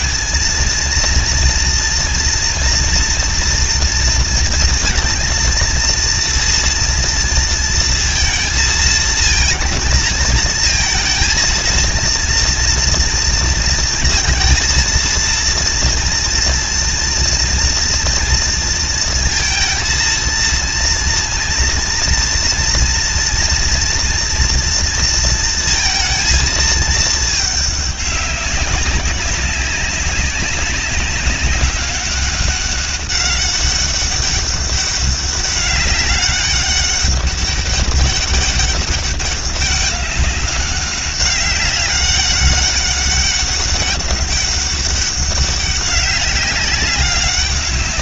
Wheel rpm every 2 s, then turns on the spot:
220, 240, 230, 230, 230, 220, 230, 230, 230, 230, 230, 230, 240, 220, 200, 190, 200, 200, 200, 200, 200, 200, 200, 200.
none